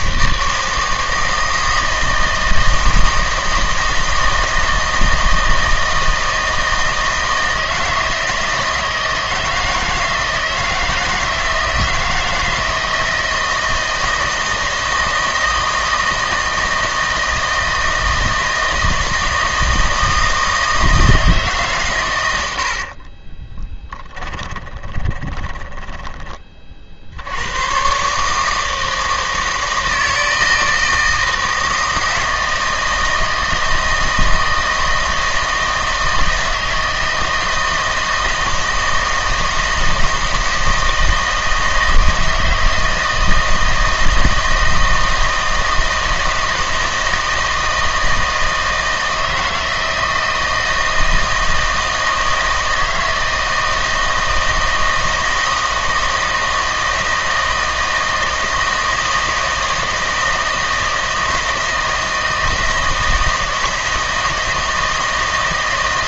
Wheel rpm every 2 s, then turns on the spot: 160, 160, 160, 160, 160, 160, 160, 160, 160, 160, 160, 70, 20, 40, 160, 160, 160, 160, 160, 160, 160, 160, 160, 160, 160, 160, 160, 160, 160, 160, 160, 160, 160.
22-26